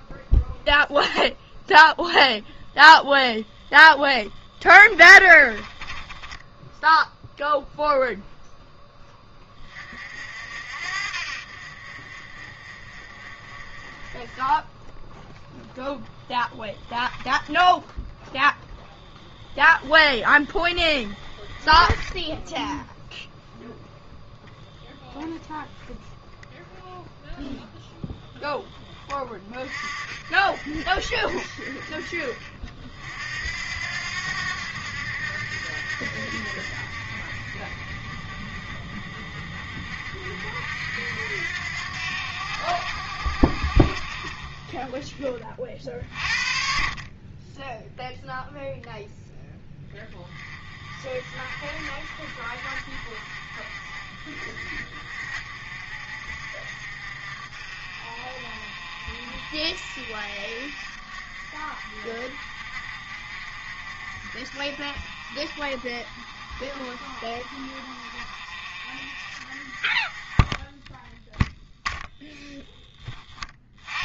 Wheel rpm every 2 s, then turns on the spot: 0, 0, 20, 10, 10, 60, 40, 10, 0, 10, 30, 0, 0, 0, 10, 50, 60, 80, 60, 40, 70, 80, 30, 50, 10, 30, 50, 50, 50, 50, 50, 50, 50, 40, 50, 10, 10.
4-8 20-22